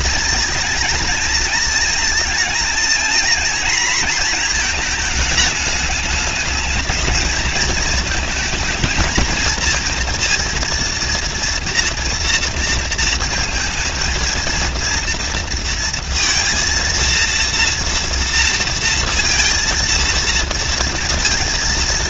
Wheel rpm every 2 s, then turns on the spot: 230, 230, 230, 210, 220, 230, 230, 230, 230, 230, 230.
none